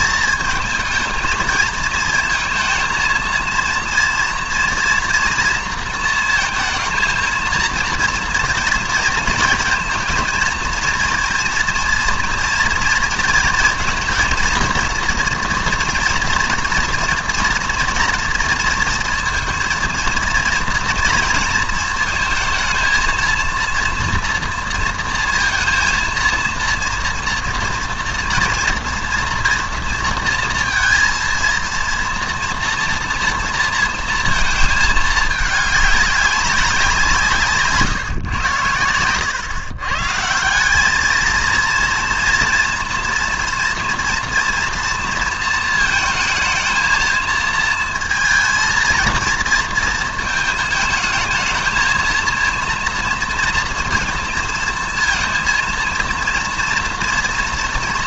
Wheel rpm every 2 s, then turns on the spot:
220, 230, 230, 220, 230, 230, 230, 230, 230, 230, 240, 230, 230, 230, 230, 230, 230, 220, 180, 100, 200, 230, 230, 220, 230, 220, 230, 230, 230.
none